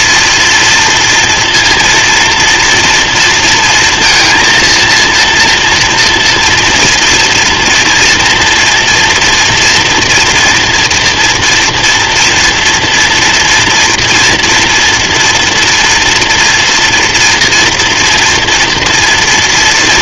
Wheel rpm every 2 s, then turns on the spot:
230, 240, 230, 230, 230, 230, 230, 230, 230, 230.
none